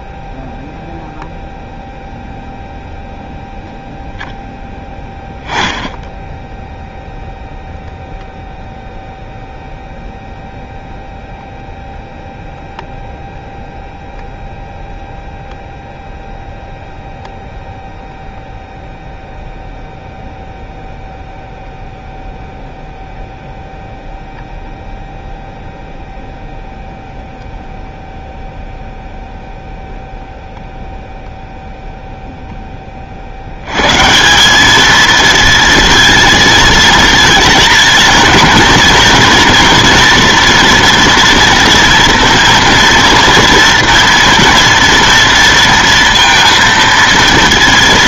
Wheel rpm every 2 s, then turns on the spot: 0, 0, 10, 0, 0, 0, 0, 0, 0, 0, 0, 0, 0, 0, 0, 0, 10, 200, 230, 230, 230, 230, 230, 230.
none